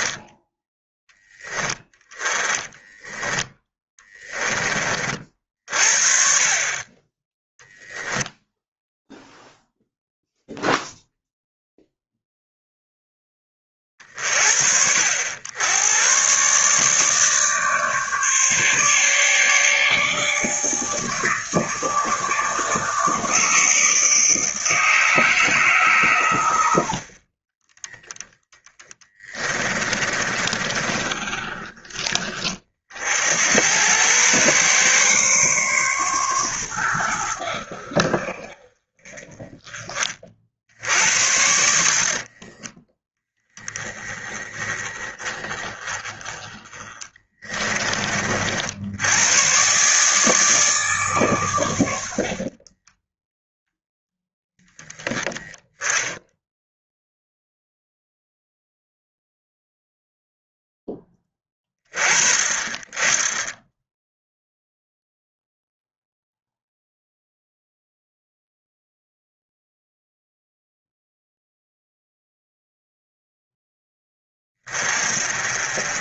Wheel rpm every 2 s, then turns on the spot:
10, 10, 30, 20, 0, 0, 0, 70, 150, 150, 150, 160, 160, 70, 20, 30, 50, 120, 110, 40, 70, 10, 20, 20, 80, 150, 20, 10, 0, 0, 10, 20, 0, 0, 0, 0, 0, 30.
2-4 28-32 46-48 52-54